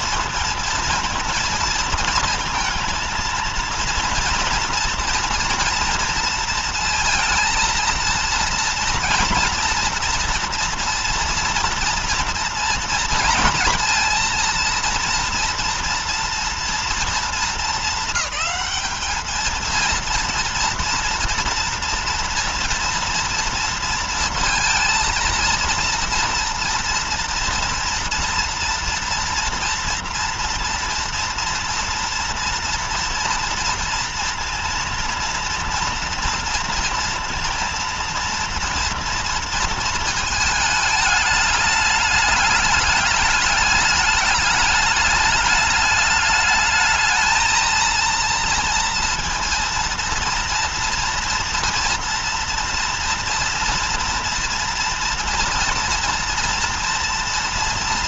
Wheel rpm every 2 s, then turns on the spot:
230, 230, 230, 230, 230, 240, 230, 230, 230, 210, 230, 230, 230, 230, 230, 230, 230, 230, 230, 230, 220, 210, 210, 210, 230, 230, 230, 230, 230.
none